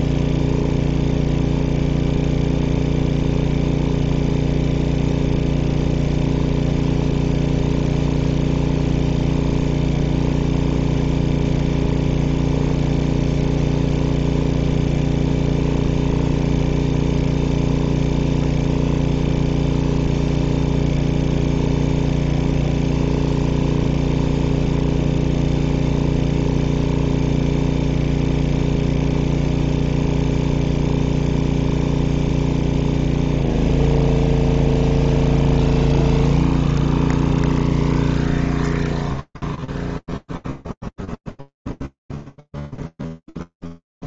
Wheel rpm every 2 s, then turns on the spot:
0, 0, 0, 0, 0, 0, 0, 0, 0, 0, 0, 0, 0, 0, 0, 0, 0, 0, 0, 0, 0, 0.
none